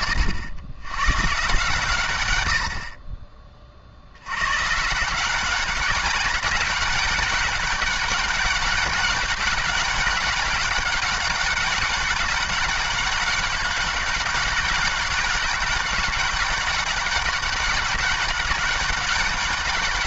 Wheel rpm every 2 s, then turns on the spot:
120, 50, 140, 200, 200, 200, 200, 200, 200, 200.
none